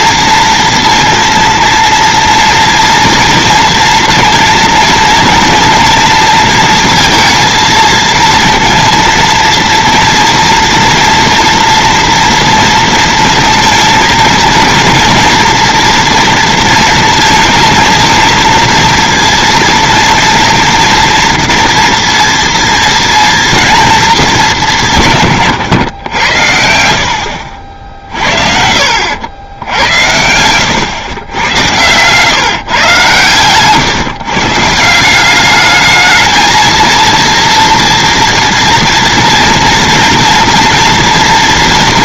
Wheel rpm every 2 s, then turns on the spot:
230, 230, 230, 230, 230, 230, 230, 230, 230, 230, 230, 230, 190, 70, 70, 110, 140, 160, 230, 230, 240.
26-32